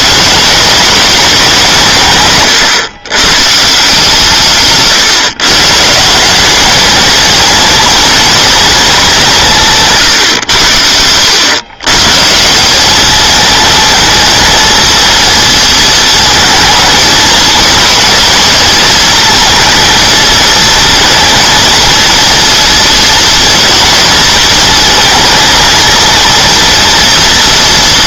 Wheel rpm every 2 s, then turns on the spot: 190, 140, 150, 200, 220, 100, 180, 230, 220, 230, 230, 240, 220, 230.
4-6